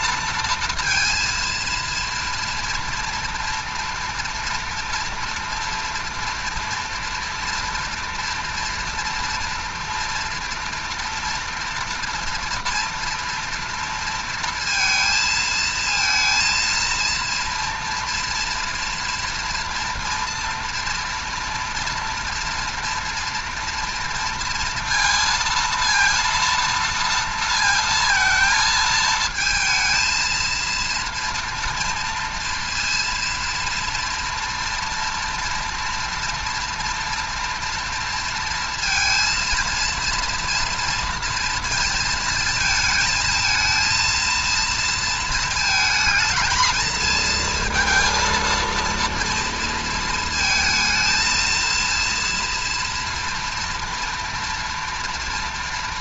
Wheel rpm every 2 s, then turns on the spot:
230, 230, 230, 230, 240, 230, 230, 230, 230, 230, 230, 230, 230, 230, 220, 230, 230, 230, 230, 230, 230, 220, 230, 220, 230, 220, 230, 230.
none